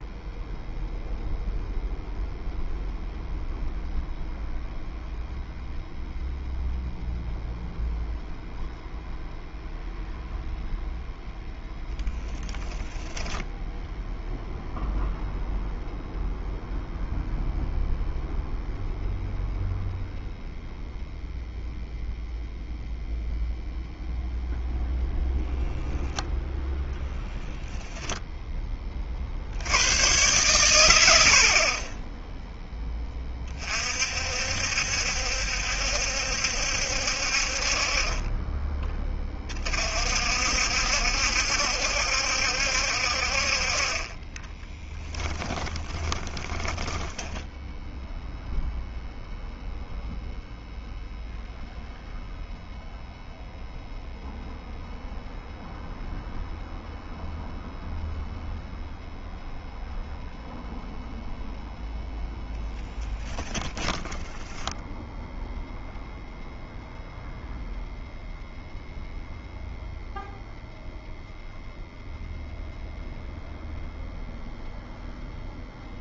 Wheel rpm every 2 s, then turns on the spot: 0, 0, 0, 0, 0, 0, 10, 0, 0, 0, 0, 0, 0, 0, 20, 110, 10, 60, 60, 30, 70, 60, 20, 10, 0, 0, 0, 0, 0, 0, 0, 10, 10, 0, 0, 0, 0, 0.
12-14 44-48 62-64